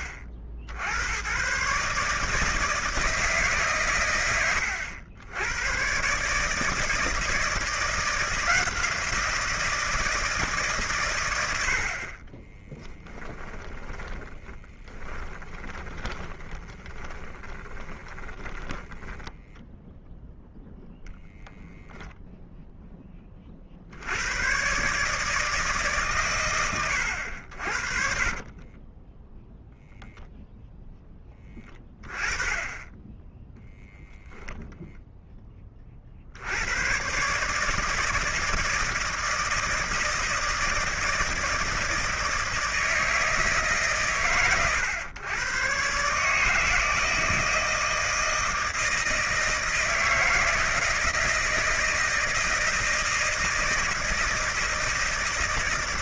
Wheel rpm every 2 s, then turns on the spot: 80, 160, 90, 150, 170, 140, 20, 20, 20, 30, 0, 10, 140, 100, 30, 0, 20, 10, 110, 160, 160, 160, 110, 160, 160, 170, 160, 160.
12-20 28-30